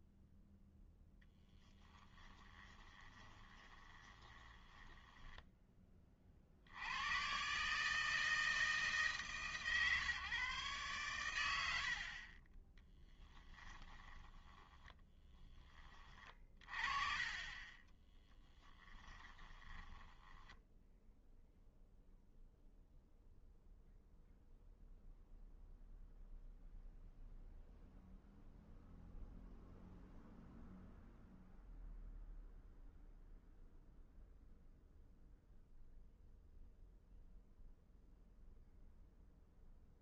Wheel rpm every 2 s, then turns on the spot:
0, 20, 10, 110, 150, 100, 10, 20, 30, 20, 0, 0, 0, 0, 0, 0, 0, 0, 0, 0.
2-6 12-16 18-20